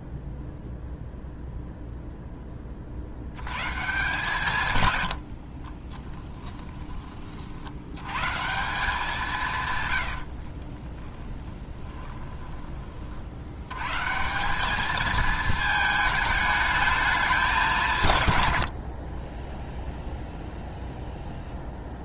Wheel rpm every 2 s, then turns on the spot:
0, 60, 90, 20, 180, 20, 50, 220, 220, 60, 0.
10-12 18-20